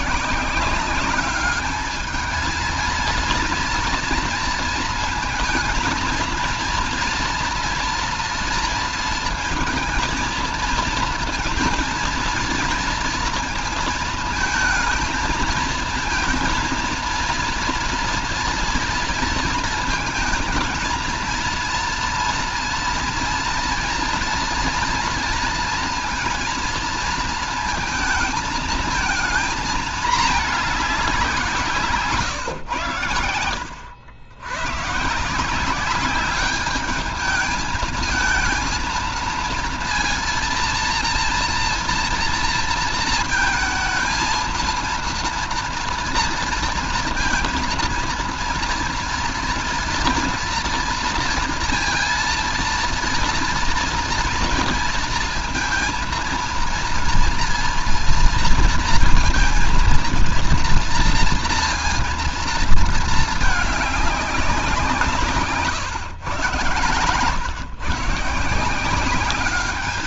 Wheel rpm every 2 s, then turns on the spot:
170, 220, 230, 230, 230, 230, 230, 220, 230, 230, 230, 230, 230, 230, 220, 220, 130, 100, 200, 220, 230, 230, 230, 230, 230, 230, 230, 230, 230, 230, 240, 230, 190, 130, 150.
none